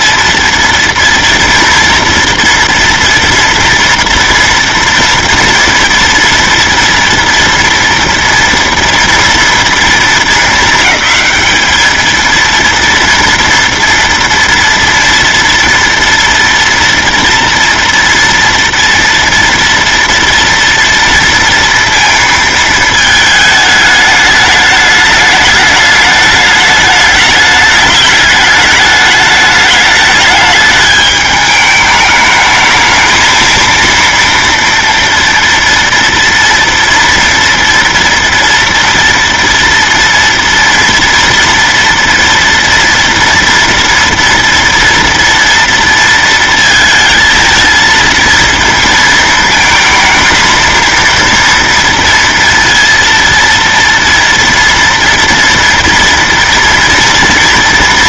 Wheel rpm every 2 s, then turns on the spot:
230, 240, 230, 230, 230, 210, 230, 230, 230, 230, 230, 230, 210, 210, 210, 210, 220, 230, 230, 230, 230, 230, 230, 230, 230, 230, 230, 230, 230.
none